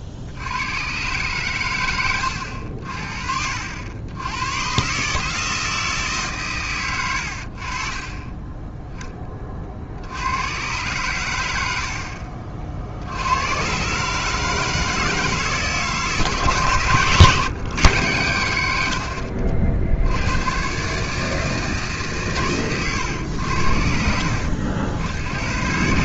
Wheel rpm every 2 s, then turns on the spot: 100, 80, 120, 130, 20, 100, 60, 150, 130, 100, 130, 120, 70.
none